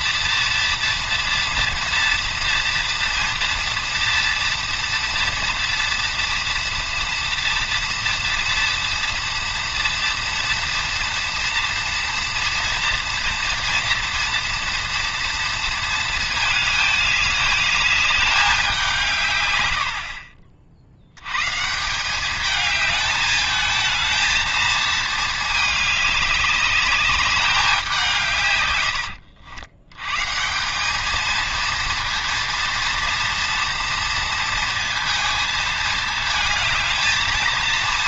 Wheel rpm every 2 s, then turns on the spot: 230, 240, 240, 230, 230, 240, 230, 230, 220, 190, 60, 210, 220, 200, 110, 180, 230, 230, 220.
none